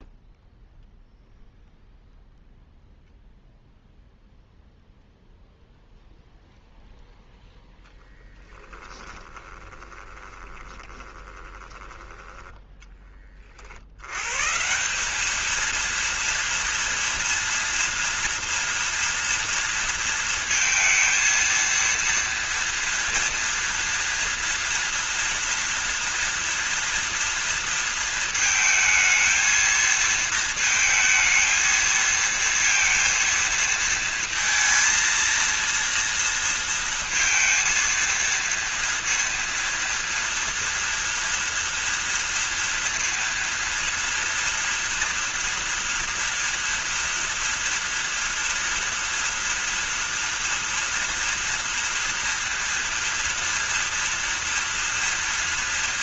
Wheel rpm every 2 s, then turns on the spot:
0, 0, 0, 0, 10, 20, 10, 140, 230, 230, 220, 230, 230, 230, 230, 230, 230, 230, 230, 230, 230, 230, 230, 230, 230, 240, 230, 230.
8-12